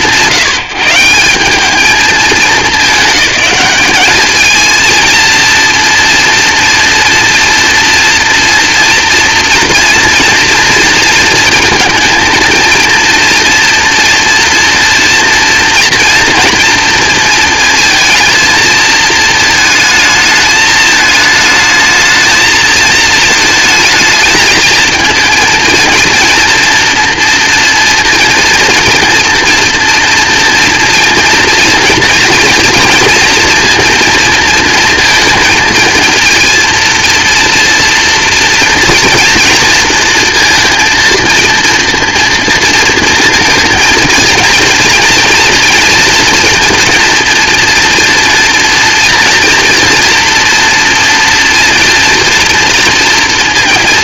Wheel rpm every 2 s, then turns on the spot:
140, 200, 230, 240, 230, 230, 230, 230, 230, 230, 220, 220, 230, 240, 230, 230, 230, 230, 230, 230, 230, 230, 230, 230, 240, 240, 230.
none